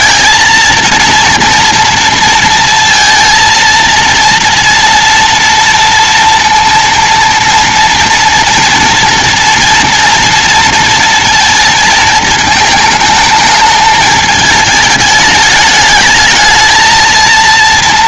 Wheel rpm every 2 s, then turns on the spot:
230, 230, 230, 230, 230, 230, 220, 220, 220.
none